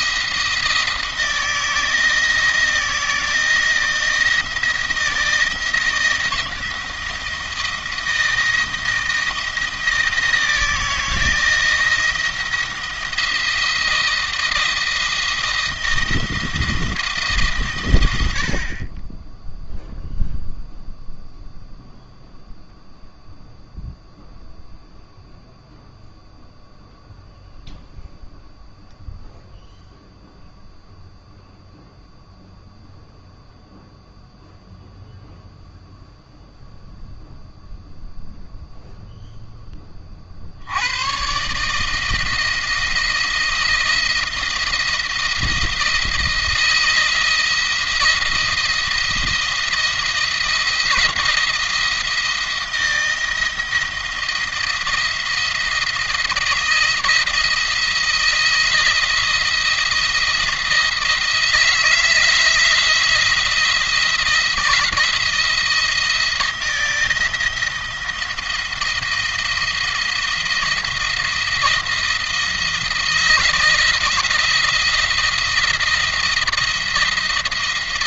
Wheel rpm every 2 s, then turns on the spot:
170, 160, 170, 160, 170, 170, 170, 170, 160, 20, 0, 0, 0, 0, 0, 0, 0, 0, 0, 0, 100, 170, 170, 170, 170, 170, 170, 170, 170, 170, 160, 170, 170, 160, 170, 170, 170, 170, 170.
none